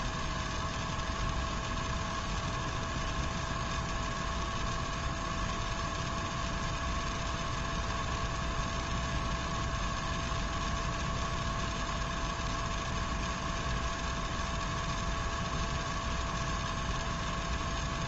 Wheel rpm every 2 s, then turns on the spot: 0, 0, 0, 0, 0, 0, 0, 0, 0.
none